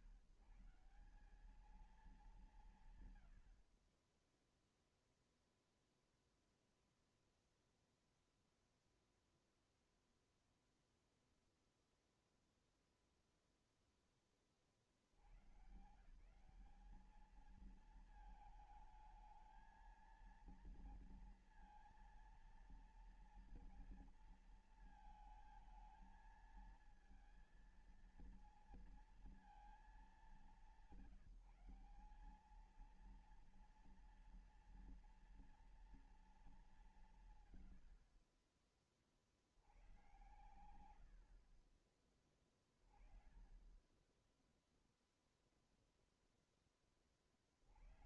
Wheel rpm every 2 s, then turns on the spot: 160, 200, 10, 0, 0, 0, 0, 0, 120, 220, 220, 230, 230, 220, 230, 200, 180, 230, 230, 70, 90, 20, 20, 0.
none